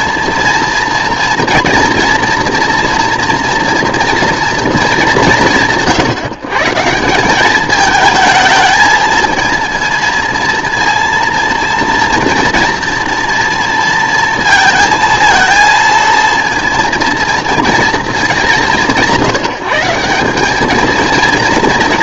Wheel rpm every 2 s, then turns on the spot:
230, 230, 230, 150, 220, 230, 230, 230, 230, 190, 210.
none